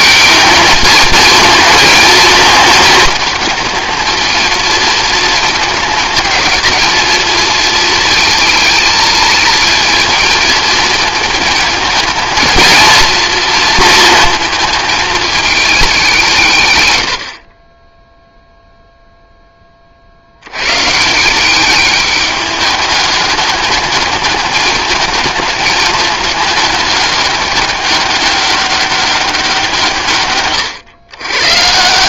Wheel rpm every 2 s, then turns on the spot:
220, 220, 230, 220, 220, 220, 230, 220, 100, 0, 140, 210, 210, 210, 200, 110.
none